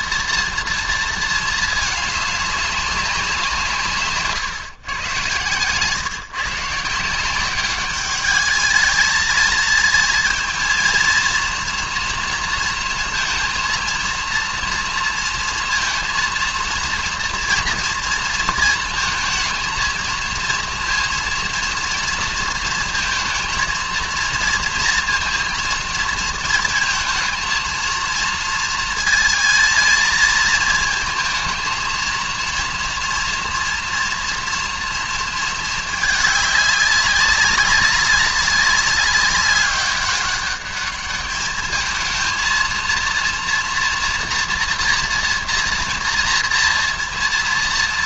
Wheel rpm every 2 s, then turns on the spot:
230, 200, 140, 140, 220, 230, 230, 230, 230, 230, 230, 230, 230, 230, 230, 220, 230, 240, 200, 200, 200, 230, 230, 230.
none